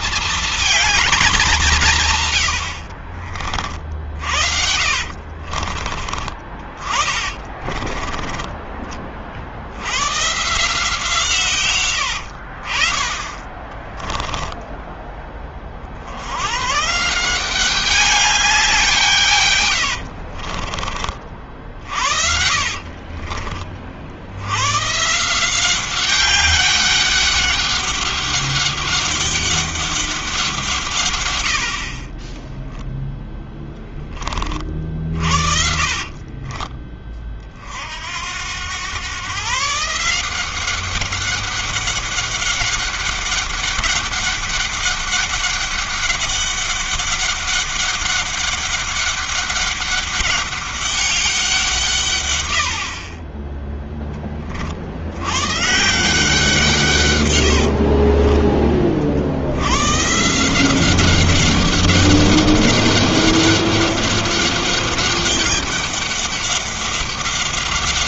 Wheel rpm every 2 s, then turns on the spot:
230, 100, 50, 40, 30, 150, 60, 10, 90, 190, 40, 50, 90, 190, 200, 170, 10, 30, 30, 90, 180, 200, 200, 200, 200, 200, 100, 40, 160, 30, 160, 200, 200, 200.
4-8 14-16 20-24 36-38 58-60